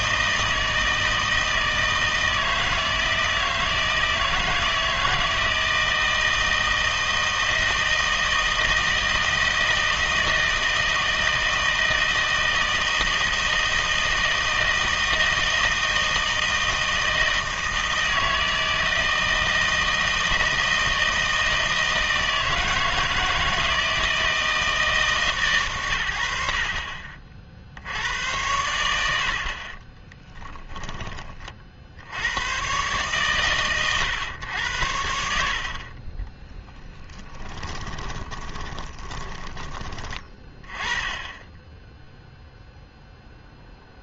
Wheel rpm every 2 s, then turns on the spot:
160, 160, 160, 160, 160, 160, 160, 160, 160, 160, 160, 160, 160, 70, 90, 20, 120, 90, 0, 20, 20, 0.
30-32 38-40